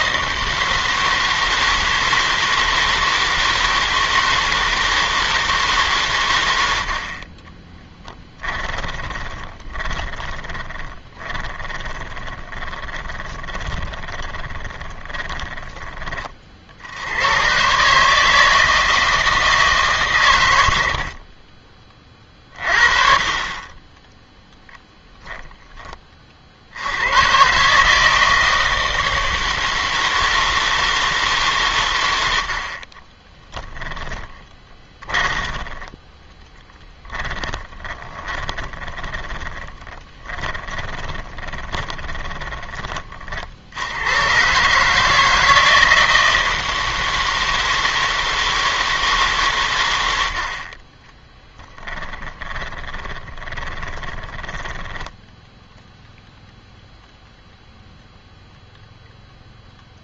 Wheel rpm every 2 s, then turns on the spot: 160, 160, 160, 80, 10, 20, 20, 20, 60, 160, 90, 30, 10, 80, 160, 160, 40, 20, 10, 20, 20, 20, 140, 160, 160, 30, 20, 10, 0, 0.
8-16 34-42 52-56